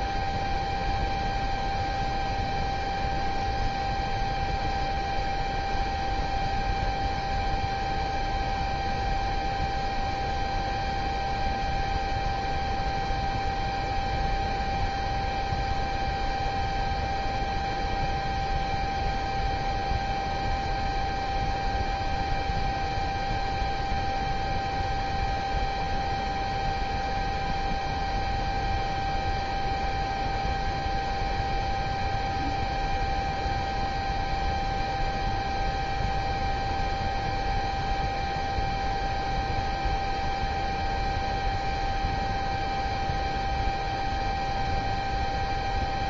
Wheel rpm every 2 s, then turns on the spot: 0, 0, 0, 0, 0, 0, 0, 0, 0, 0, 0, 0, 0, 0, 0, 0, 0, 0, 0, 0, 0, 0, 0.
none